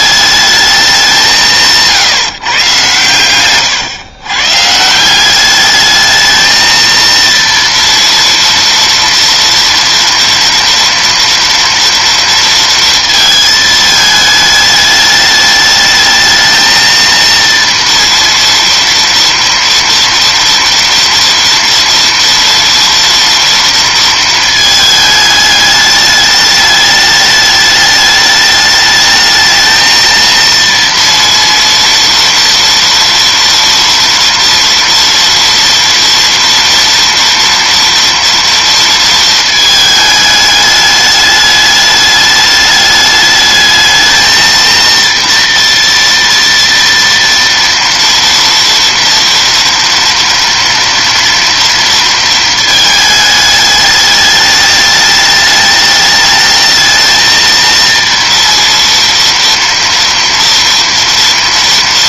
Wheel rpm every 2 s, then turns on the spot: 210, 130, 140, 230, 230, 230, 230, 210, 220, 230, 230, 230, 220, 210, 210, 230, 230, 230, 230, 230, 210, 210, 230, 230, 240, 230, 220, 210, 220, 230, 230.
none